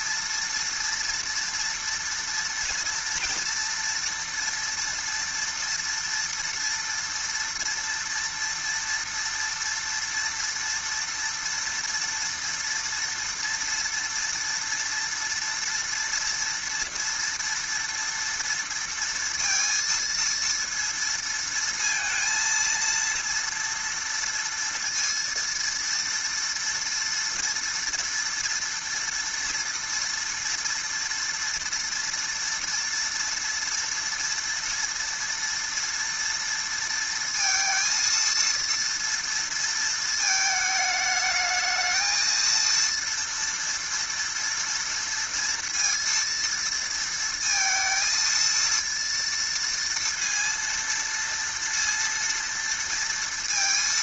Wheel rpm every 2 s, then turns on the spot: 230, 230, 230, 230, 230, 230, 240, 240, 230, 230, 230, 230, 230, 230, 230, 230, 230, 230, 230, 230, 220, 230, 230, 230, 230, 230, 230.
none